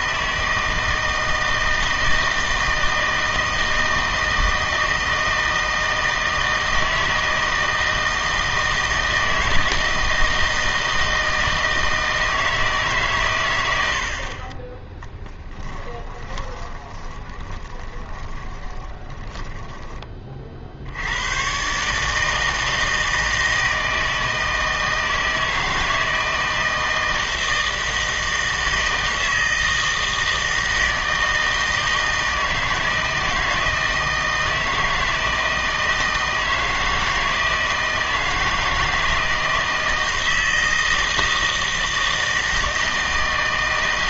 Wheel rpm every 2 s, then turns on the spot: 160, 160, 160, 160, 160, 160, 150, 20, 20, 20, 60, 160, 160, 160, 160, 160, 160, 160, 160, 160, 160, 160.
16-20